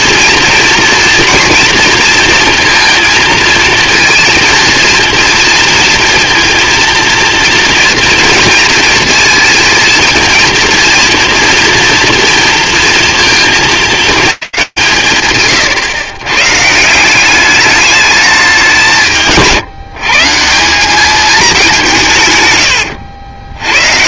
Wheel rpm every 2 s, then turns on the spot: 240, 230, 230, 230, 220, 230, 230, 200, 130, 200, 170, 130.
22-24